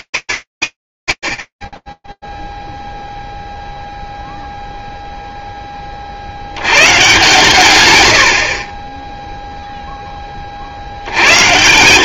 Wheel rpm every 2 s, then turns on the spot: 180, 0, 0, 80, 80, 40.
none